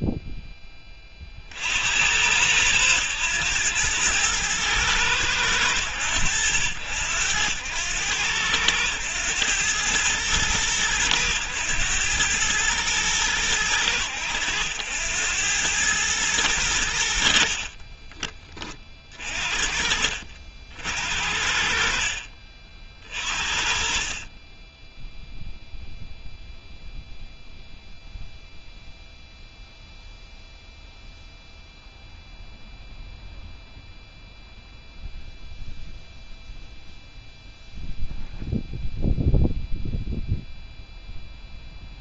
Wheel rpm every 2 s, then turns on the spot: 10, 80, 110, 90, 90, 110, 100, 100, 110, 40, 60, 60, 30, 0, 0, 0, 0, 0, 0, 0, 0.
22-24